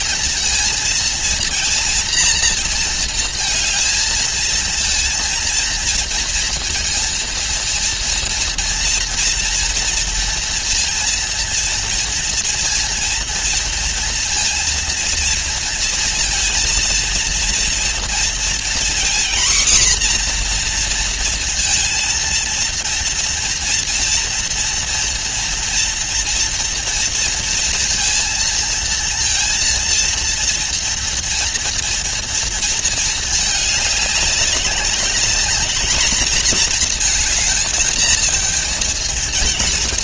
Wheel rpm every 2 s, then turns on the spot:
230, 230, 230, 230, 230, 230, 230, 230, 230, 240, 240, 230, 230, 230, 230, 230, 230, 200, 230, 220.
none